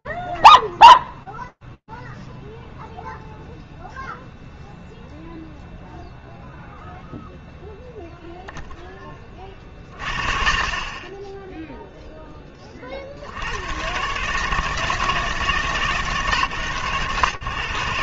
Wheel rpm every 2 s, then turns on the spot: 0, 0, 0, 10, 20, 50, 150, 130, 60.
none